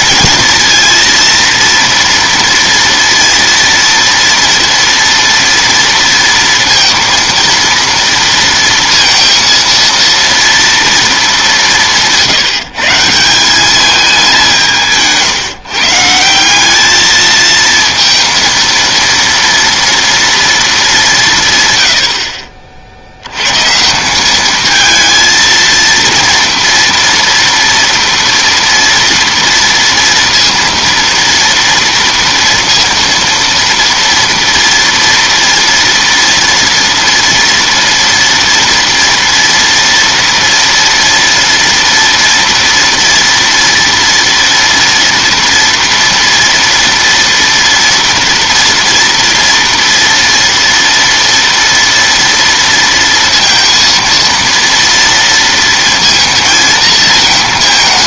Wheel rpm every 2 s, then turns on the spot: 230, 230, 230, 230, 230, 230, 160, 170, 200, 230, 210, 60, 220, 230, 230, 230, 230, 230, 230, 230, 230, 240, 230, 230, 230, 230, 230, 230, 230.
none